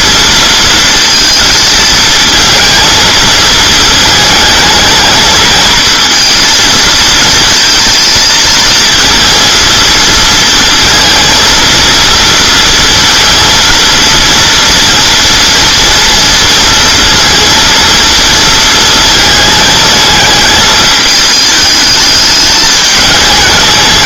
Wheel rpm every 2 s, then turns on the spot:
230, 230, 220, 230, 230, 230, 230, 230, 230, 230, 220, 210.
none